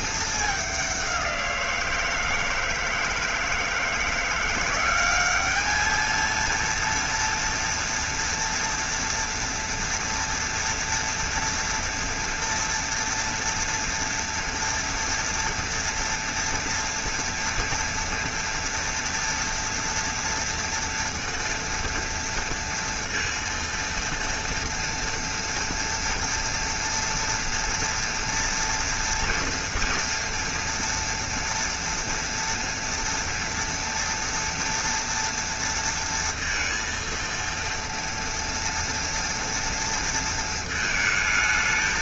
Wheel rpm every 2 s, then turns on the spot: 200, 160, 190, 230, 230, 230, 240, 230, 230, 230, 230, 230, 230, 230, 240, 230, 230, 230, 230, 230, 220.
none